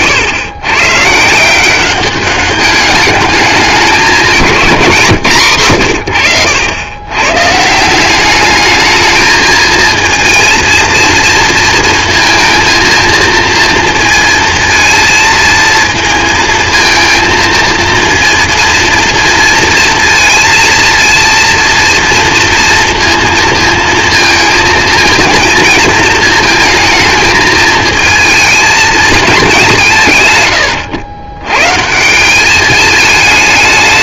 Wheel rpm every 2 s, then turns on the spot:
120, 200, 170, 90, 210, 230, 220, 230, 220, 230, 230, 230, 230, 220, 220, 100, 210.
none